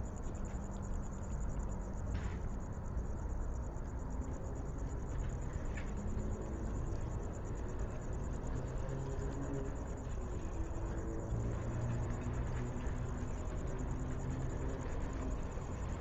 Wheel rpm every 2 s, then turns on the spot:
0, 0, 0, 0, 0, 0, 0, 0.
none